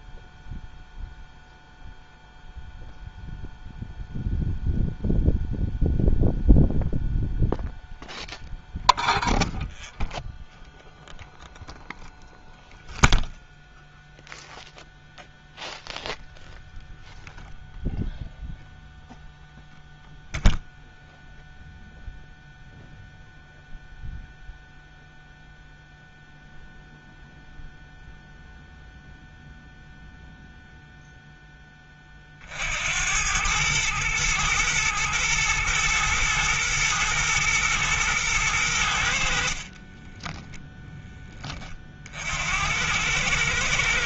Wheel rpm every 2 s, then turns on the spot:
0, 0, 0, 0, 0, 0, 0, 0, 0, 0, 0, 0, 0, 0, 0, 0, 60, 110, 120, 100, 0, 90.
none